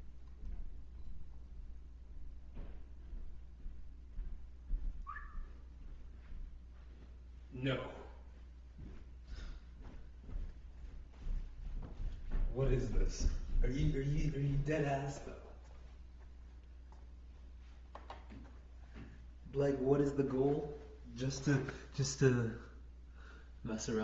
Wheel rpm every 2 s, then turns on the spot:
0, 0, 0, 0, 0, 0, 0, 0, 0, 0, 0, 0.
none